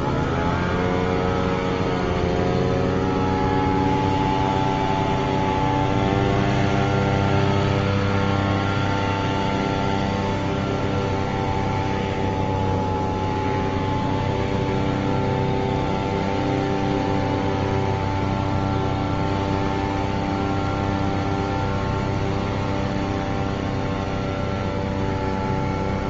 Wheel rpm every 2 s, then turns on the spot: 0, 0, 0, 0, 0, 0, 0, 0, 0, 0, 0, 0, 0.
none